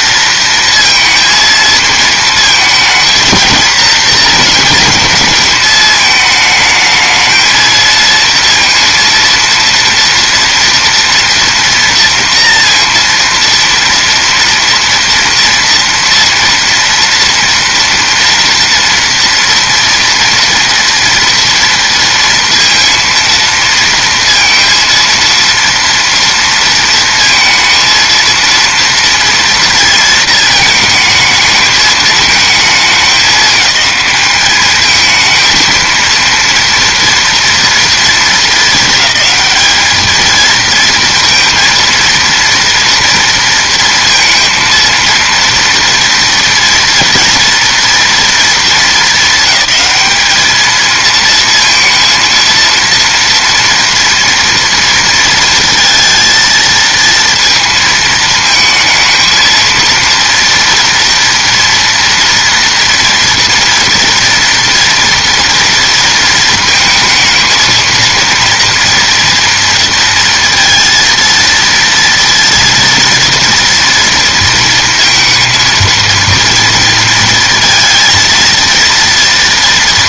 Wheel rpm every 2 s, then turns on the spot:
230, 230, 220, 220, 230, 230, 230, 230, 230, 230, 230, 230, 230, 230, 230, 220, 220, 210, 230, 220, 230, 230, 230, 230, 220, 210, 230, 230, 230, 220, 230, 230, 230, 220, 230, 230, 230, 230, 230, 230.
none